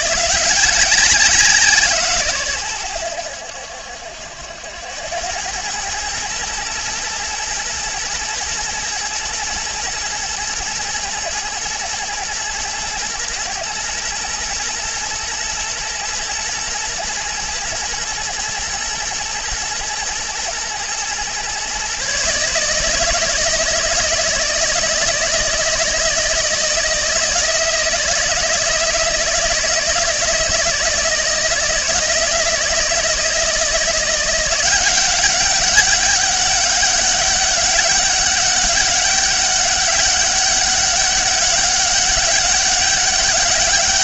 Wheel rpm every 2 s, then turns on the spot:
180, 100, 90, 110, 120, 110, 120, 110, 120, 120, 120, 160, 160, 160, 160, 160, 160, 180, 200, 200, 200, 200.
none